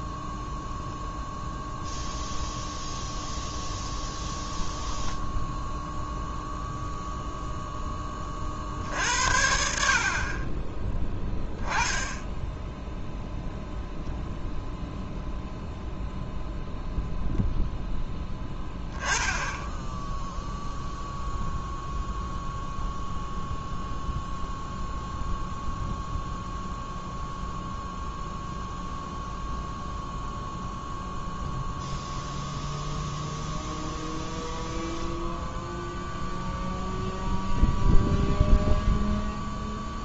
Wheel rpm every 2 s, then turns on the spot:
0, 0, 10, 0, 60, 20, 0, 0, 0, 10, 0, 0, 0, 0, 0, 0, 0, 0, 0, 0.
none